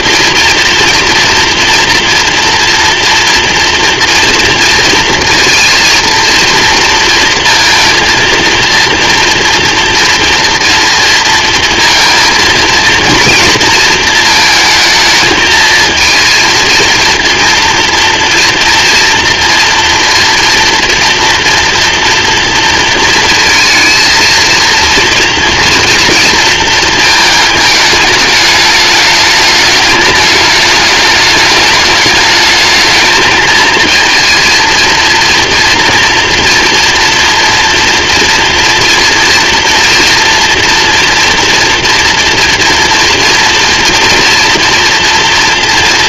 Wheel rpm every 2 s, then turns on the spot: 230, 240, 230, 230, 230, 230, 230, 220, 230, 230, 230, 230, 240, 230, 210, 210, 210, 220, 240, 230, 230, 240, 230.
none